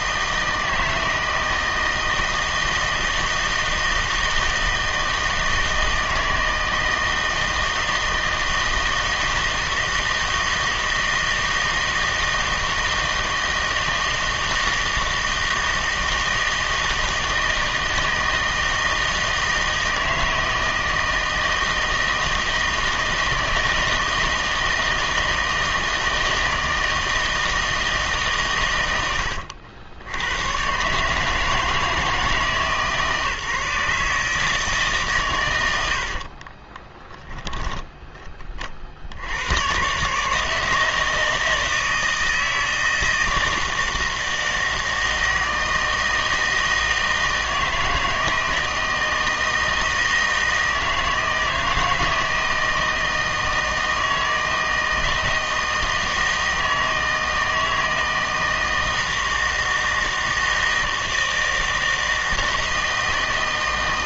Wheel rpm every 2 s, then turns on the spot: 160, 160, 160, 160, 160, 160, 160, 160, 160, 160, 160, 160, 160, 160, 130, 120, 150, 150, 20, 30, 150, 160, 160, 160, 160, 160, 160, 160, 160, 160, 160, 160.
36-38